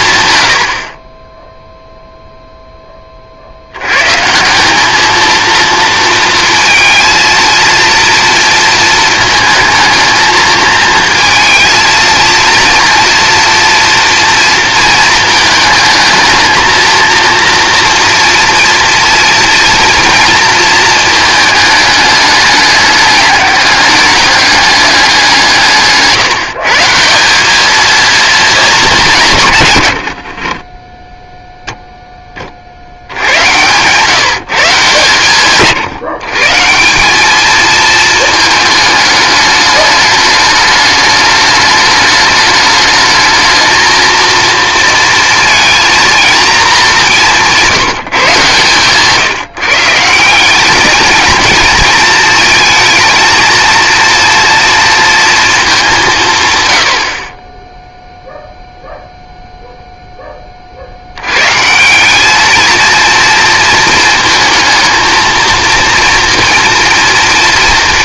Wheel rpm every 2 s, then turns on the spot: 80, 10, 190, 230, 230, 220, 230, 230, 230, 230, 230, 210, 200, 160, 220, 30, 40, 150, 170, 220, 220, 210, 230, 210, 130, 200, 220, 230, 120, 0, 50, 220, 230, 240.
48-50